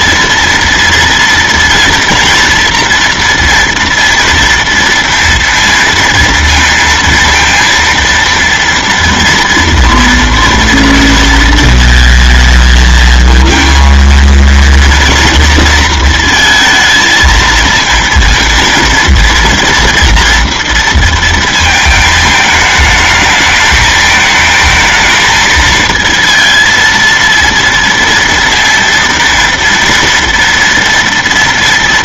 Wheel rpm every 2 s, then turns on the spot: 230, 230, 230, 230, 230, 230, 220, 230, 230, 230, 230, 220, 220, 230, 230, 230.
none